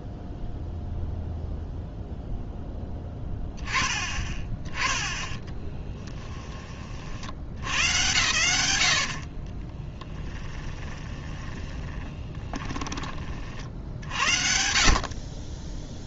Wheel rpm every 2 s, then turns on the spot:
0, 10, 10, 30, 100, 20, 20, 50.
8-14